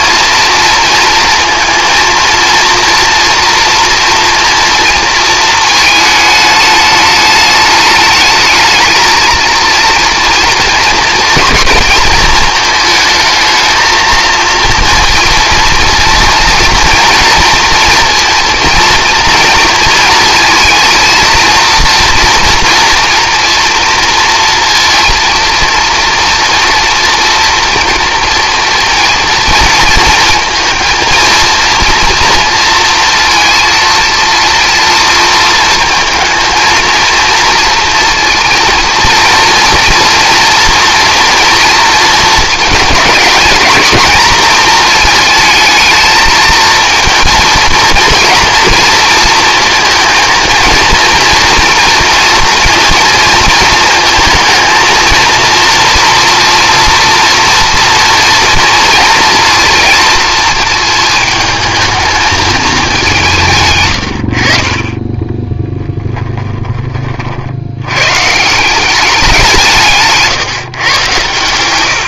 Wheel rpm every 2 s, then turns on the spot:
230, 230, 230, 220, 220, 230, 220, 230, 230, 230, 220, 240, 230, 230, 230, 230, 230, 230, 230, 230, 230, 220, 230, 230, 230, 230, 230, 220, 230, 230, 230, 220, 50, 20, 160, 130.
66-68